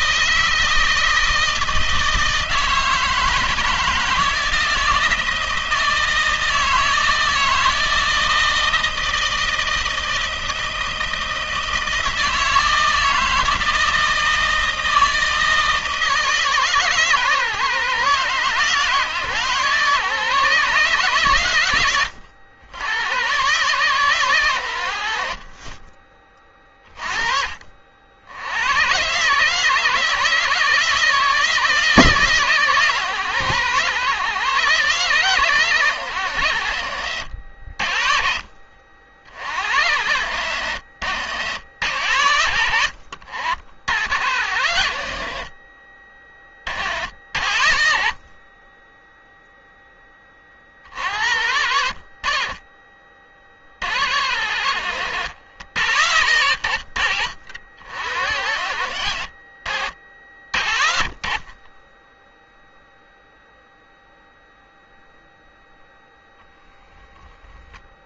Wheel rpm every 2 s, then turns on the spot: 160, 160, 160, 160, 160, 160, 160, 160, 150, 140, 150, 90, 120, 30, 70, 150, 150, 130, 110, 50, 100, 90, 70, 30, 30, 20, 40, 70, 80, 80, 60, 10, 0, 0.
none